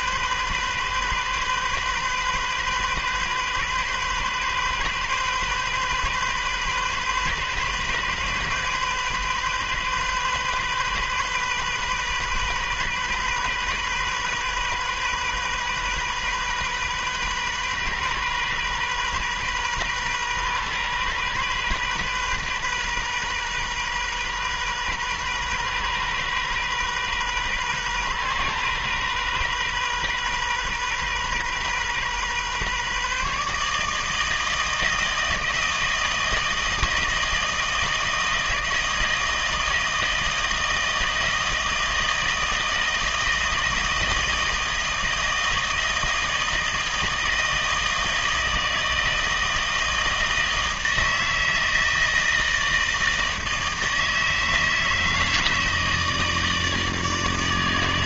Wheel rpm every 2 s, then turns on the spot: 130, 130, 130, 130, 130, 130, 130, 130, 130, 130, 130, 130, 130, 130, 130, 130, 140, 160, 160, 160, 160, 160, 160, 160, 160, 160, 160, 160, 160.
none